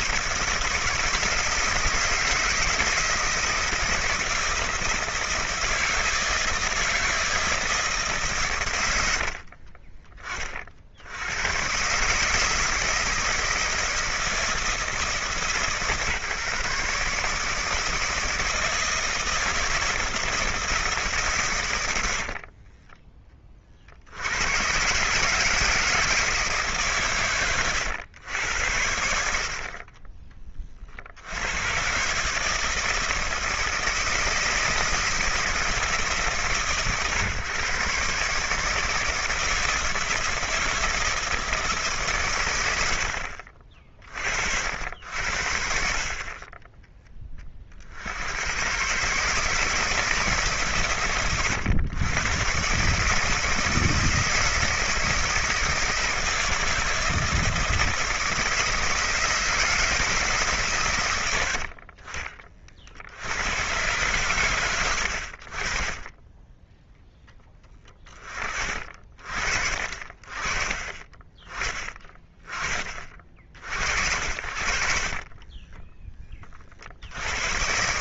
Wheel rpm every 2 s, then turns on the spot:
160, 160, 160, 160, 130, 40, 160, 160, 140, 160, 160, 40, 120, 150, 90, 40, 160, 160, 130, 150, 160, 100, 70, 20, 110, 130, 140, 160, 160, 160, 140, 40, 110, 10, 40, 30, 30, 50, 50.
22-24